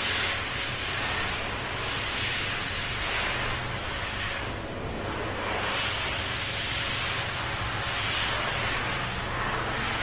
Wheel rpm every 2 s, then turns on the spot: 10, 10, 0, 0, 10.
none